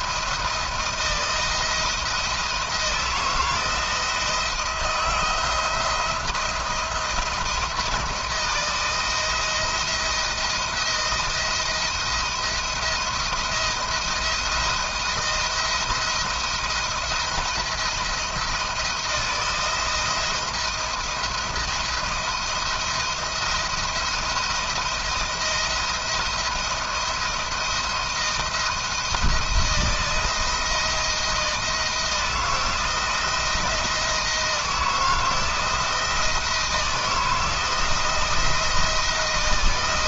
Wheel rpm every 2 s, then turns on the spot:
170, 170, 160, 170, 160, 170, 170, 170, 170, 170, 170, 170, 170, 160, 170, 170, 170, 160, 170, 160.
none